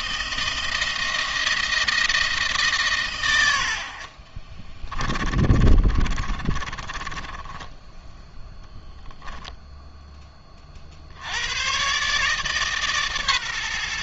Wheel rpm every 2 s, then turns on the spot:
160, 150, 30, 30, 0, 40, 150.
4-8